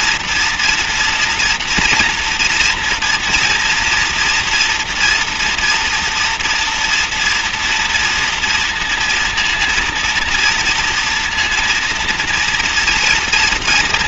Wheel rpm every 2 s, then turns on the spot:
240, 230, 230, 240, 230, 230, 230.
none